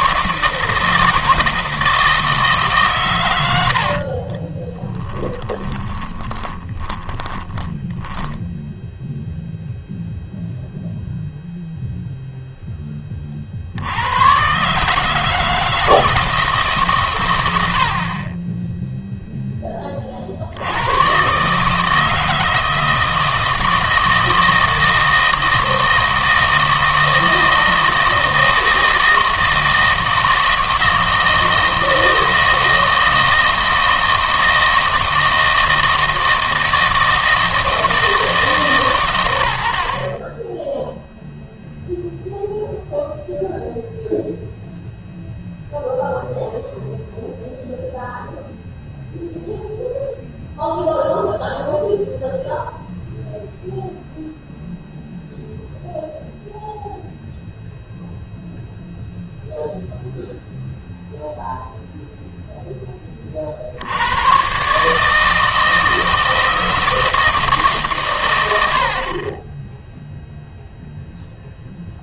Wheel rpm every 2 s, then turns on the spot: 170, 150, 20, 20, 0, 0, 0, 140, 150, 10, 80, 160, 160, 160, 160, 160, 160, 160, 160, 140, 10, 0, 0, 0, 0, 0, 0, 0, 0, 0, 0, 0, 140, 160, 80, 0.
4-8